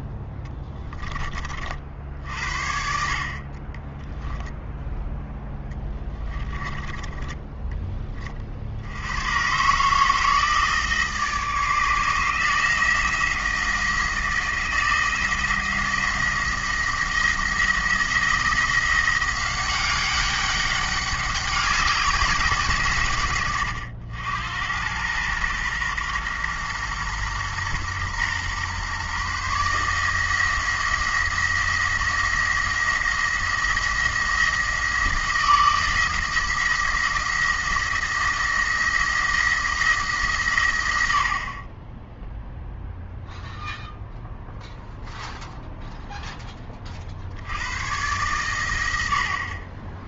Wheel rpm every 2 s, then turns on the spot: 10, 60, 0, 20, 70, 160, 160, 170, 170, 170, 200, 170, 100, 120, 130, 170, 170, 170, 170, 160, 110, 0, 0, 20, 90.
0-2 6-8